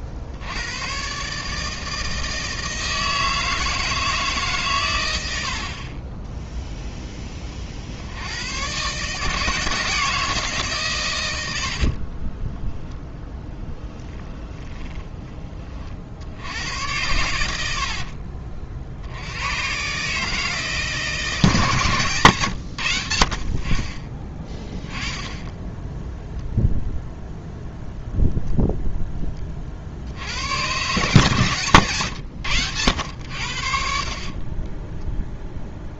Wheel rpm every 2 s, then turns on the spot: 80, 160, 140, 10, 110, 150, 20, 20, 90, 50, 150, 110, 10, 0, 0, 110, 100, 20.
12-16